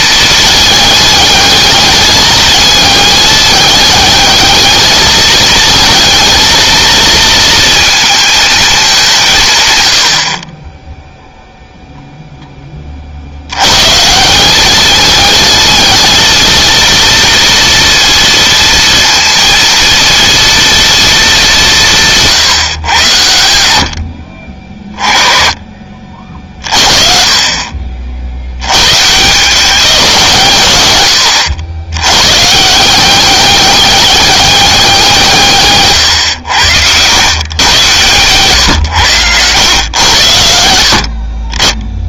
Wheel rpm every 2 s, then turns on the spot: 210, 210, 220, 230, 200, 10, 40, 210, 230, 230, 220, 120, 40, 40, 130, 100, 180, 190, 100, 120, 60.
none